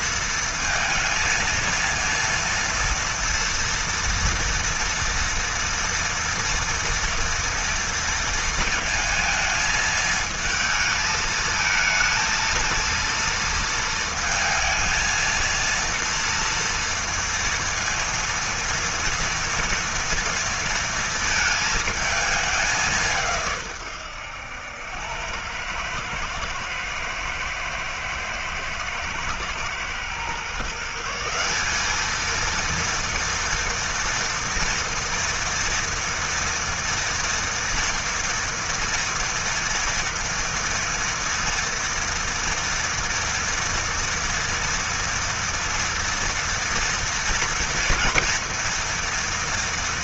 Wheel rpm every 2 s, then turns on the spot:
230, 230, 230, 230, 220, 220, 230, 230, 230, 230, 230, 180, 100, 110, 110, 170, 230, 240, 230, 230, 230, 230, 230, 230, 230.
none